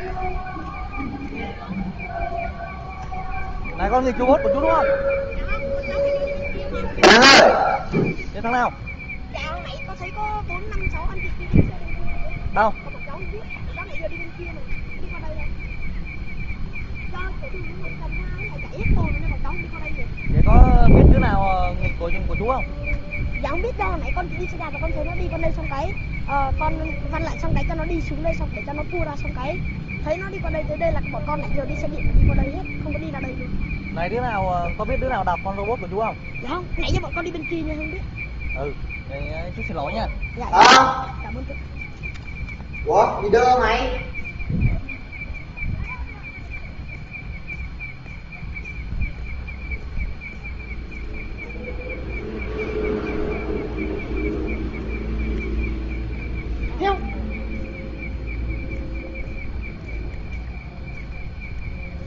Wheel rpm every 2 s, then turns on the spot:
0, 0, 0, 0, 0, 0, 0, 0, 0, 0, 0, 0, 0, 0, 0, 0, 0, 0, 0, 0, 0, 0, 0, 0, 0, 0, 0, 0, 0, 0, 0.
none